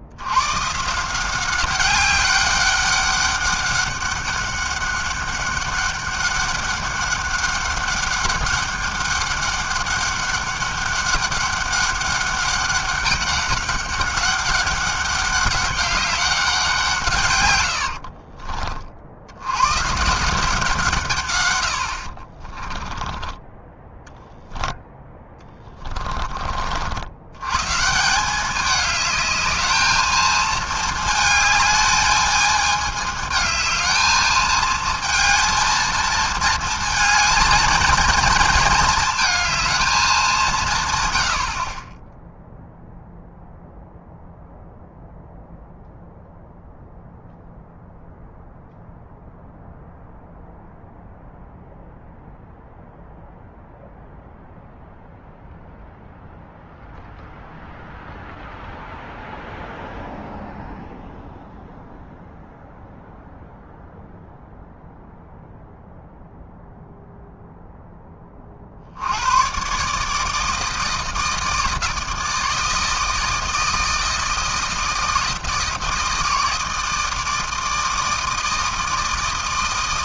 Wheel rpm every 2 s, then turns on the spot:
120, 200, 200, 200, 200, 200, 200, 200, 190, 50, 170, 30, 0, 40, 190, 220, 210, 220, 230, 230, 170, 0, 0, 0, 0, 0, 0, 0, 0, 0, 0, 0, 0, 0, 40, 160, 160, 160, 160, 160.
22-24